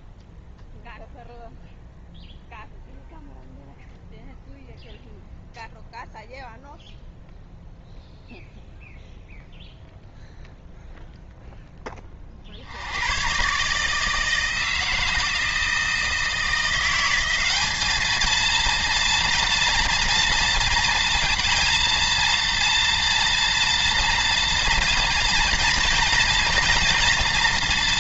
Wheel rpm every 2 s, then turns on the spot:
0, 0, 0, 0, 0, 0, 80, 160, 170, 230, 230, 230, 230, 230.
none